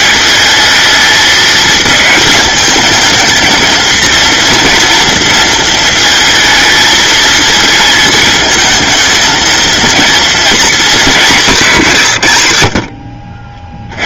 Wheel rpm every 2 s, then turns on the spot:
220, 220, 230, 220, 230, 220, 50.
none